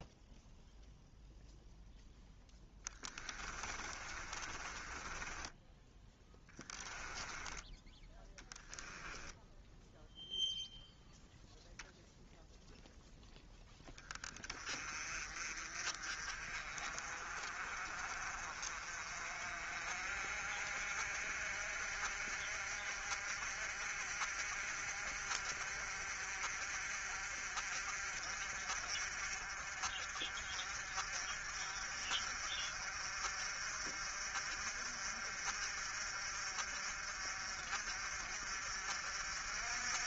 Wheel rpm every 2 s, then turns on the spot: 0, 10, 20, 10, 10, 0, 0, 30, 40, 40, 50, 50, 50, 50, 50, 50, 50, 50, 50, 50.
2-10